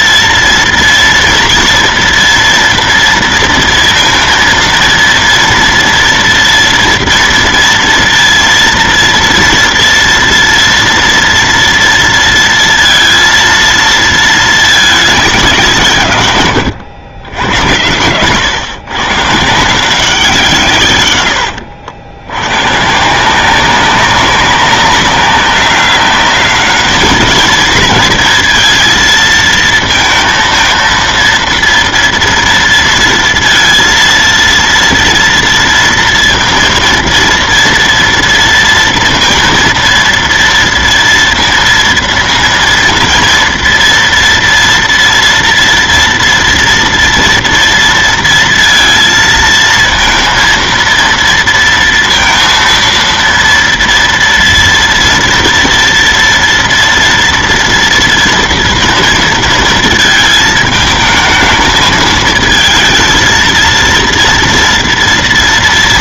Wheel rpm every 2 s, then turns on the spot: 230, 230, 230, 230, 230, 230, 230, 220, 110, 130, 150, 110, 190, 210, 220, 230, 230, 230, 230, 230, 230, 230, 230, 230, 230, 230, 230, 230, 230, 230, 220, 220, 230.
none